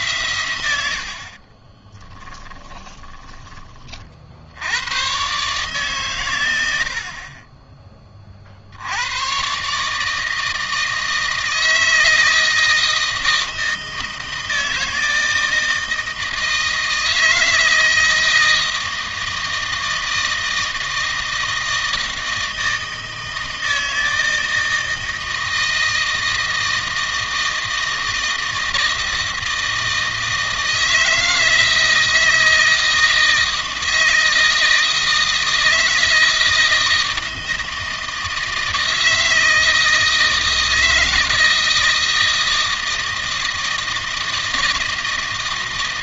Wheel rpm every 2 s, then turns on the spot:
100, 10, 80, 100, 60, 160, 160, 160, 160, 160, 160, 160, 160, 160, 160, 160, 160, 160, 160, 160, 160, 160, 160.
0-4